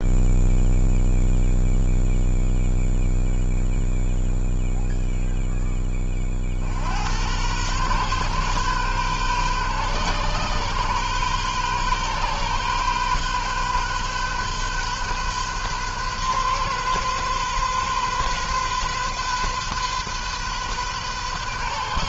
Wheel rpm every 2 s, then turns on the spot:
0, 0, 0, 90, 130, 130, 130, 130, 130, 130, 130.
none